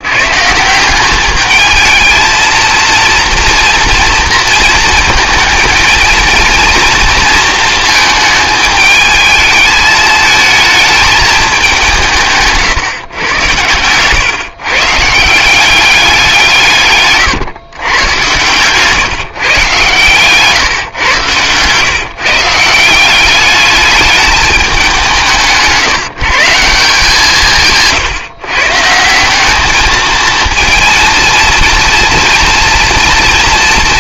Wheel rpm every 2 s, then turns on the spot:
180, 230, 230, 230, 220, 220, 140, 140, 150, 130, 130, 170, 190, 180, 160, 230, 240.
none